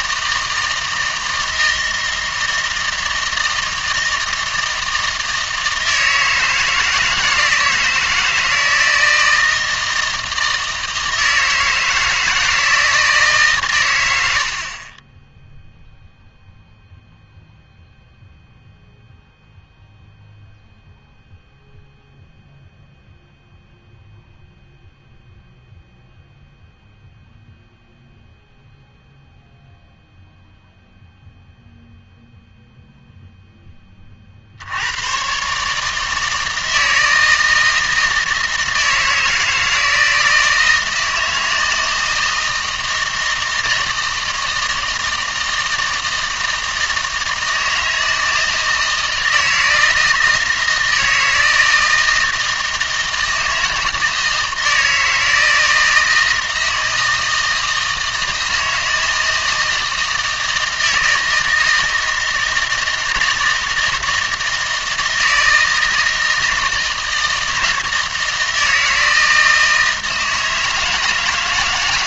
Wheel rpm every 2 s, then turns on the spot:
160, 160, 160, 160, 160, 160, 160, 30, 0, 0, 0, 0, 0, 0, 0, 0, 0, 80, 160, 160, 160, 160, 160, 160, 160, 160, 160, 160, 160, 160, 160, 160, 160, 160, 160, 160.
none